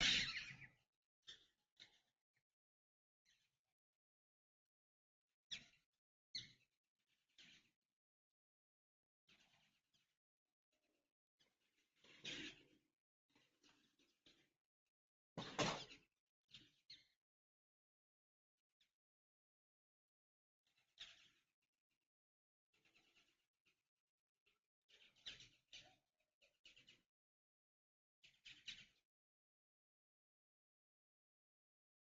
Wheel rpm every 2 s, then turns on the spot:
0, 0, 0, 0, 0, 0, 0, 0, 0, 0, 0, 0, 0, 0, 0, 0.
none